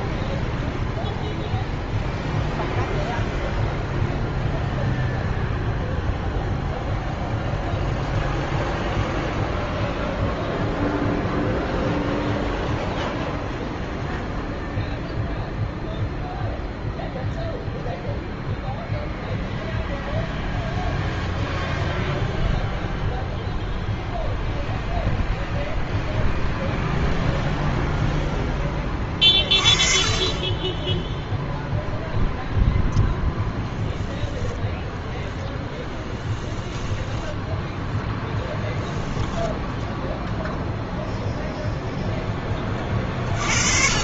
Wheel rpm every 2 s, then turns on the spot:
0, 0, 0, 0, 0, 0, 0, 0, 0, 0, 0, 0, 0, 0, 10, 10, 0, 0, 10, 10, 0, 30.
36-40